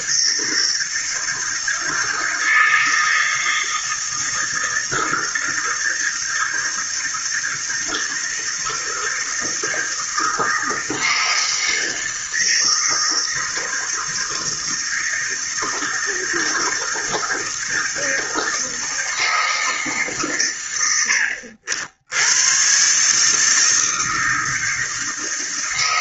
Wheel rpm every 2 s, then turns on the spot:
160, 160, 160, 160, 160, 160, 160, 160, 160, 160, 100, 130, 160.
none